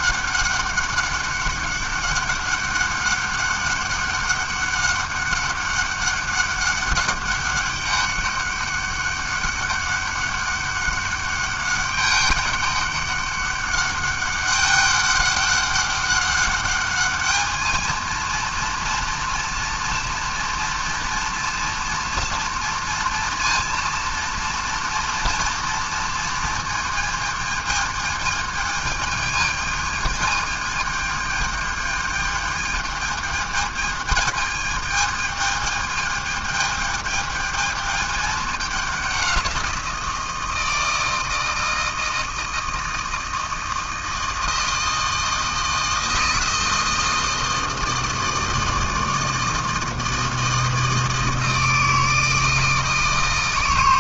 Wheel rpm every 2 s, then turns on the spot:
200, 200, 200, 200, 200, 200, 200, 200, 200, 230, 230, 230, 230, 230, 220, 220, 220, 220, 220, 210, 160, 160, 160, 160, 160, 160, 160.
none